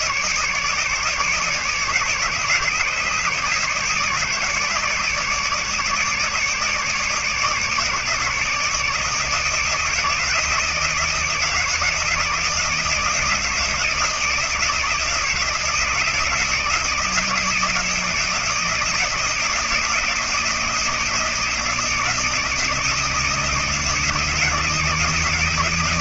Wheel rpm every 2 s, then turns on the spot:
150, 150, 150, 150, 150, 160, 160, 160, 160, 160, 160, 160, 160.
none